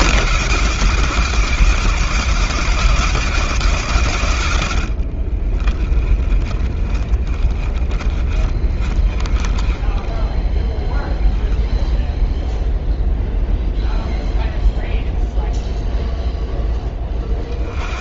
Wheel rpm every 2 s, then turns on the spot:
150, 160, 110, 30, 30, 20, 0, 0, 0.
4-10